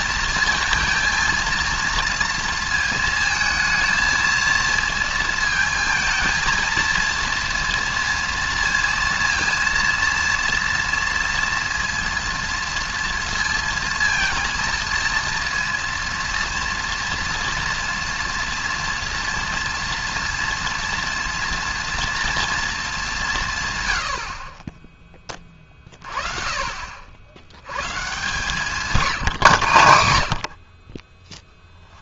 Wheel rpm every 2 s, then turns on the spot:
220, 220, 230, 230, 230, 230, 230, 230, 240, 230, 230, 220, 30, 50, 150, 50.
none